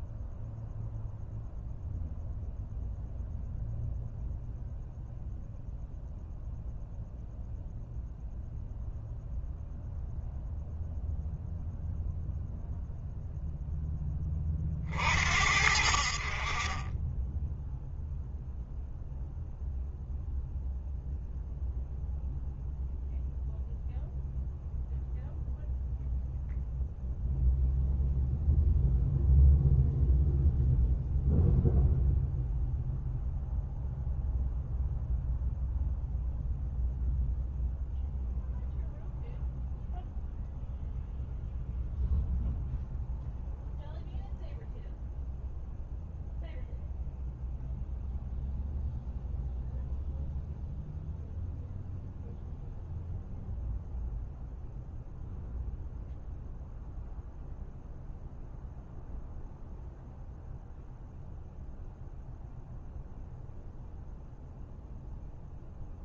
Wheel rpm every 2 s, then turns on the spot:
0, 0, 0, 0, 0, 0, 0, 50, 20, 0, 0, 0, 0, 0, 0, 0, 0, 0, 0, 0, 0, 0, 0, 0, 0, 0, 0, 0, 0, 0, 0, 0, 0.
none